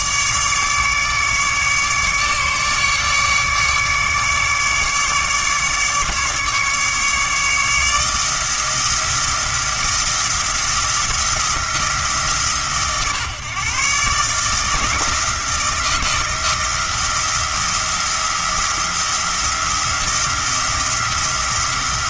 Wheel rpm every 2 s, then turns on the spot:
150, 150, 150, 150, 160, 170, 140, 160, 170, 170, 170.
none